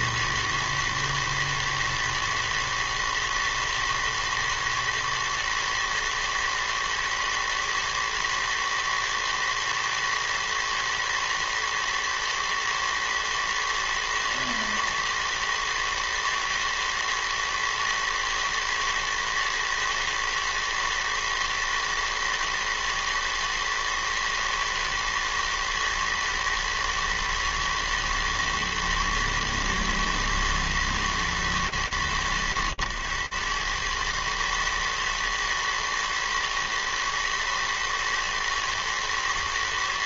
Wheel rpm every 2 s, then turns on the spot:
120, 120, 120, 110, 110, 110, 110, 110, 110, 120, 110, 110, 110, 110, 110, 110, 100, 110, 110, 110.
none